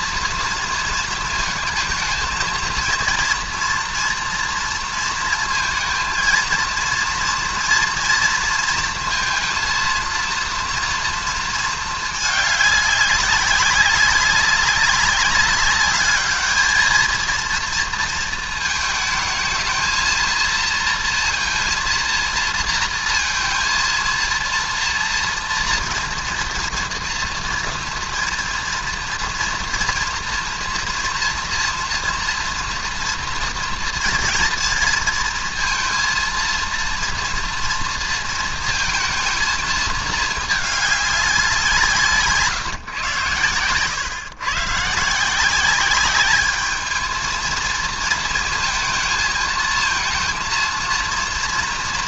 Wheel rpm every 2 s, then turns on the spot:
240, 230, 230, 230, 230, 230, 210, 190, 210, 230, 220, 230, 230, 230, 230, 240, 230, 230, 230, 230, 220, 160, 130, 200, 220, 230.
none